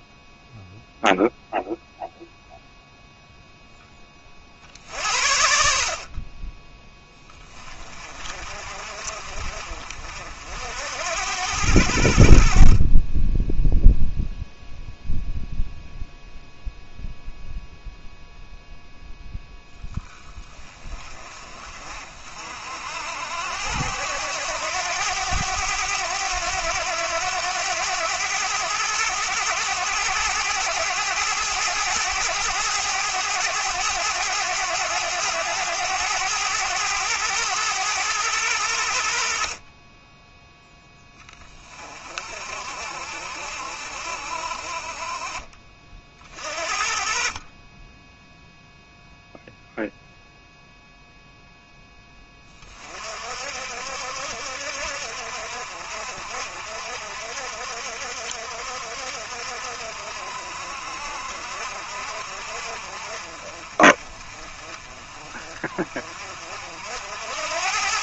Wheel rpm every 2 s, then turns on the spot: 0, 0, 60, 10, 40, 60, 40, 0, 0, 0, 20, 60, 90, 90, 100, 110, 110, 100, 100, 80, 10, 50, 50, 40, 0, 0, 30, 60, 60, 60, 60, 50, 40, 60.
none